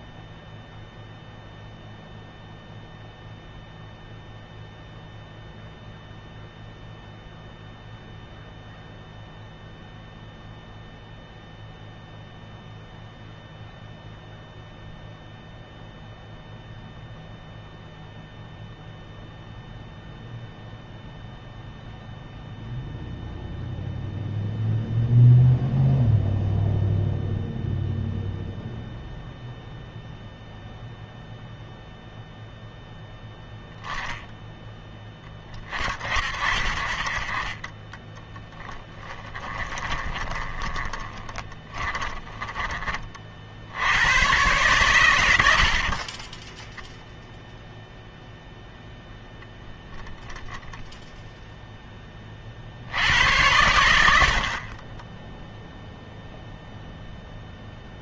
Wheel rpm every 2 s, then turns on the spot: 0, 0, 0, 0, 0, 0, 0, 0, 0, 0, 0, 0, 0, 0, 0, 0, 10, 10, 40, 10, 30, 20, 120, 0, 0, 10, 60, 30, 0.
38-42